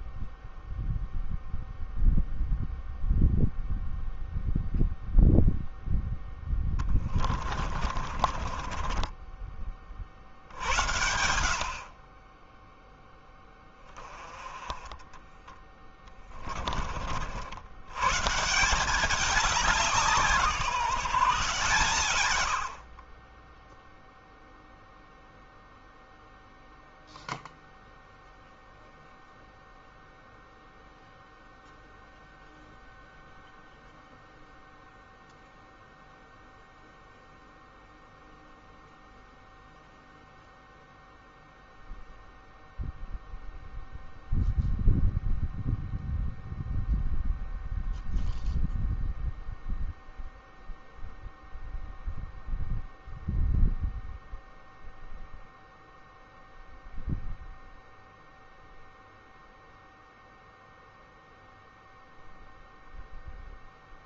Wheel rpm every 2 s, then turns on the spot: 0, 0, 0, 20, 30, 80, 10, 10, 50, 190, 160, 40, 0, 0, 0, 0, 0, 0, 0, 0, 0, 0, 0, 0, 0, 0, 0, 0, 0, 0, 0, 0.
6-10 14-16